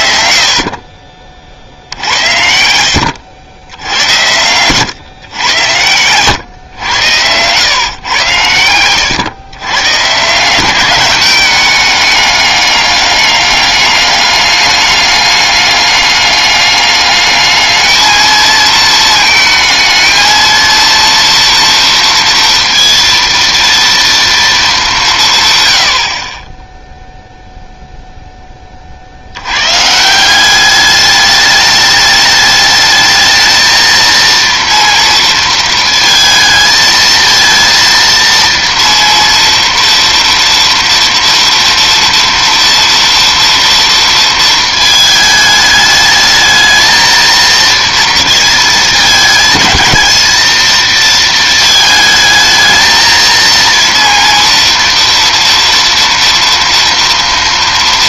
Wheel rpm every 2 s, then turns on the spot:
50, 80, 130, 100, 110, 190, 200, 200, 210, 220, 230, 230, 180, 0, 90, 210, 220, 230, 230, 230, 240, 230, 220, 230, 210, 220, 230, 230, 230.
none